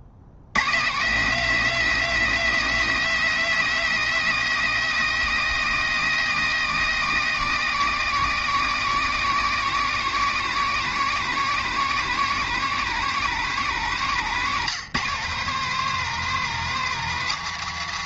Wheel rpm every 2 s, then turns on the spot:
130, 230, 230, 220, 220, 220, 210, 180, 210.
none